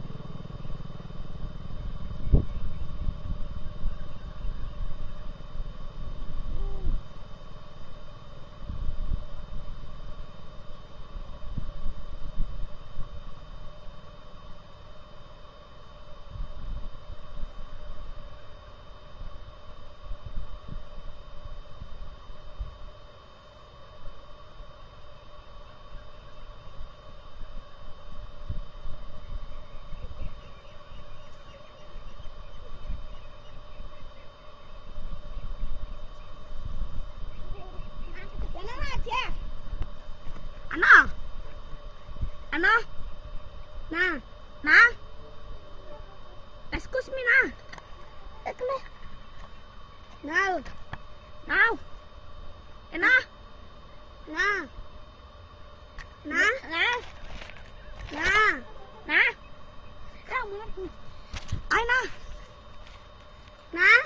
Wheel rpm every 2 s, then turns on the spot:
0, 0, 0, 0, 0, 0, 0, 0, 0, 0, 0, 0, 0, 0, 0, 0, 0, 0, 0, 0, 0, 0, 0, 0, 0, 0, 0, 0, 0, 0, 0, 0.
none